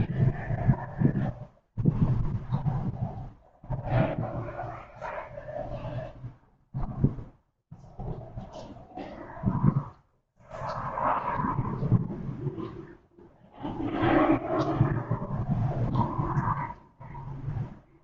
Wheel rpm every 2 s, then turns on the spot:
0, 0, 0, 0, 0, 0, 0, 0, 0.
none